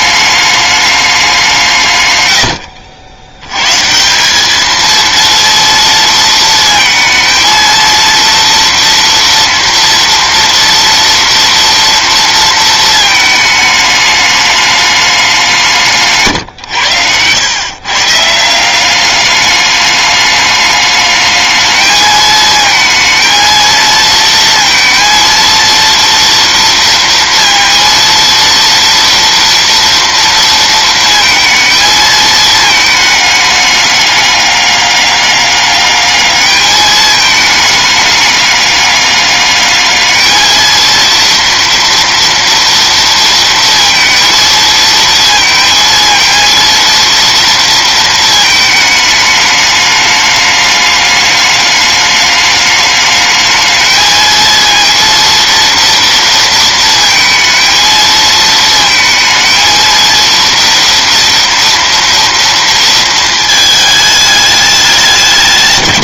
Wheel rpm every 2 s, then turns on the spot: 210, 90, 220, 230, 230, 230, 230, 210, 110, 170, 210, 220, 230, 230, 230, 230, 220, 200, 210, 200, 230, 230, 220, 230, 220, 210, 210, 230, 230, 220, 230, 230, 210.
none